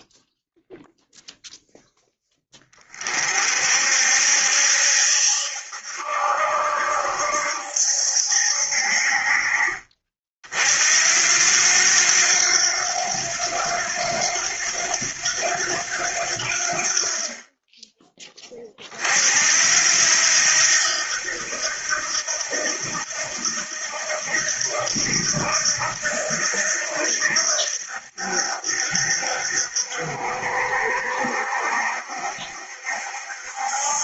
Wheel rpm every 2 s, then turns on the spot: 0, 40, 70, 70, 50, 80, 90, 90, 50, 60, 80, 80, 80, 70, 60, 60, 70.
none